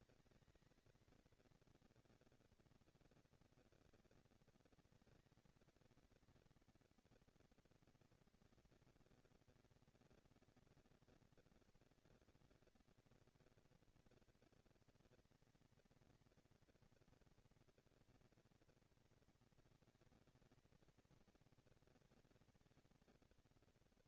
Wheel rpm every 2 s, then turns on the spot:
220, 230, 230, 230, 240, 230, 230, 230, 230, 230, 230, 230.
none